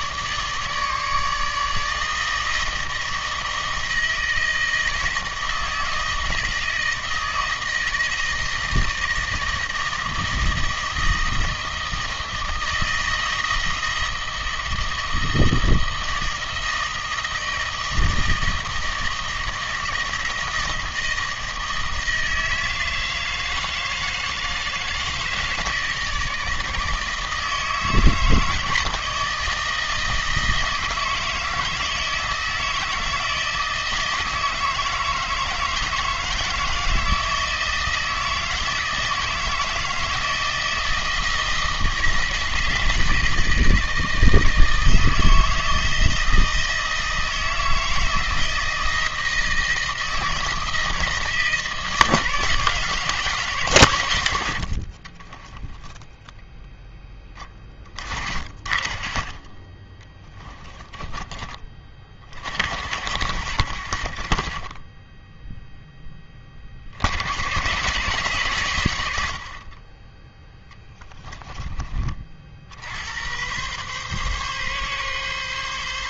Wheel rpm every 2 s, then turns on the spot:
150, 160, 160, 160, 160, 160, 160, 160, 160, 160, 160, 160, 160, 160, 160, 160, 160, 160, 160, 160, 160, 160, 160, 160, 160, 160, 160, 70, 10, 40, 10, 70, 30, 50, 110, 10, 70, 140.
60-62 70-72